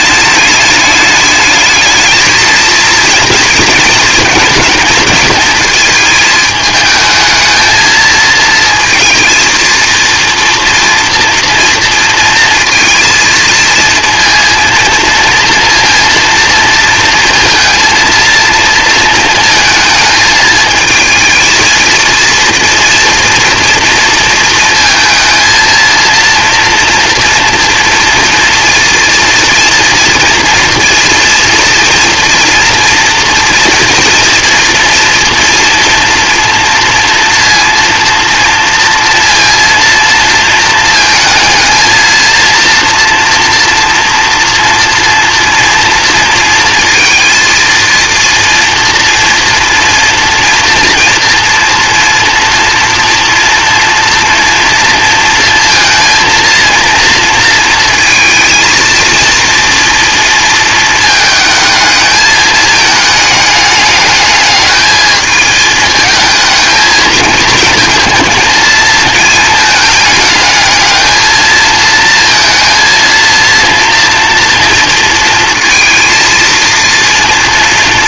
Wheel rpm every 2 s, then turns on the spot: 210, 220, 220, 210, 230, 240, 220, 230, 230, 230, 220, 230, 230, 240, 230, 230, 230, 230, 230, 230, 220, 230, 230, 230, 230, 240, 230, 230, 230, 220, 230, 210, 210, 220, 220, 220, 230, 230, 230.
none